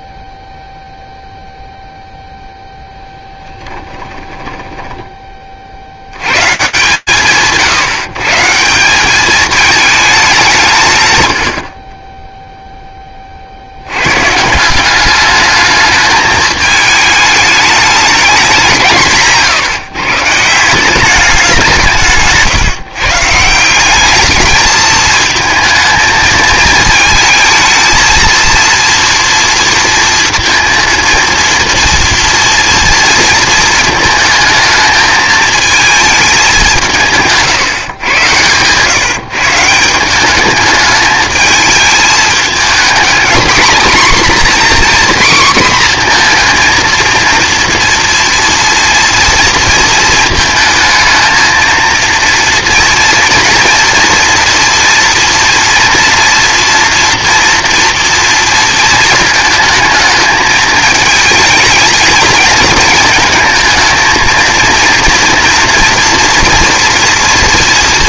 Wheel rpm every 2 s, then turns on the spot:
0, 10, 10, 120, 180, 150, 30, 200, 220, 160, 190, 150, 220, 230, 240, 230, 230, 220, 160, 140, 220, 230, 250, 230, 230, 220, 230, 230, 230, 220, 220, 230, 230, 240.
4-6